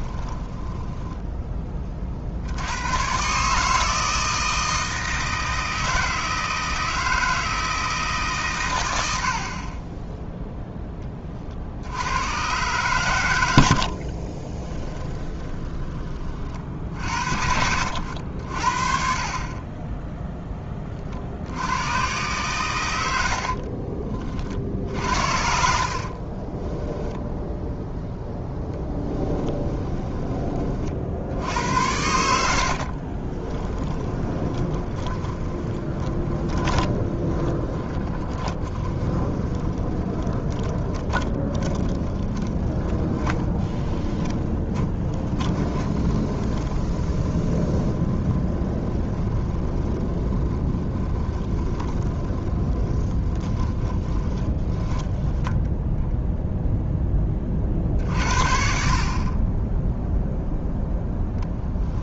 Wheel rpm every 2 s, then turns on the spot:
20, 100, 160, 160, 100, 10, 120, 30, 60, 50, 30, 120, 50, 10, 10, 40, 60, 20, 20, 20, 30, 20, 20, 20, 20, 20, 20, 10, 0, 60, 0.
0-2 14-16 26-30 32-56